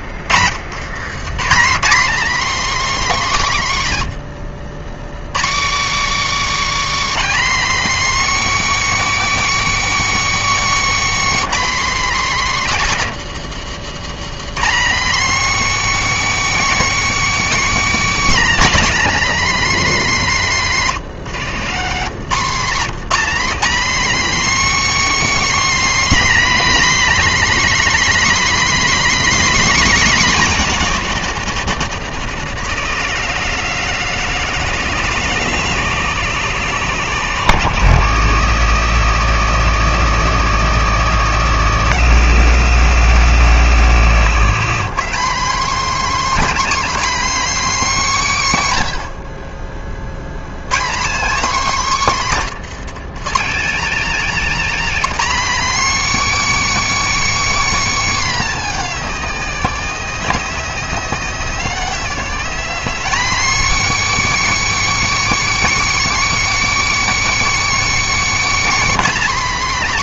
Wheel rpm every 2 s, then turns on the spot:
80, 290, 110, 320, 320, 310, 250, 240, 330, 300, 230, 190, 310, 310, 300, 220, 150, 150, 130, 80, 80, 90, 140, 270, 170, 130, 200, 280, 320, 240, 190, 230, 320, 320, 310.
none